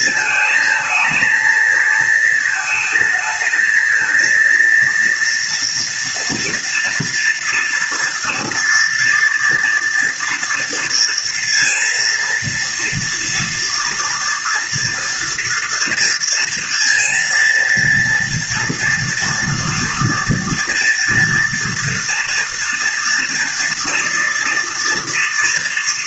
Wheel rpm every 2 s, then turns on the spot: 220, 220, 230, 230, 230, 230, 230, 230, 230, 230, 230, 230, 230.
none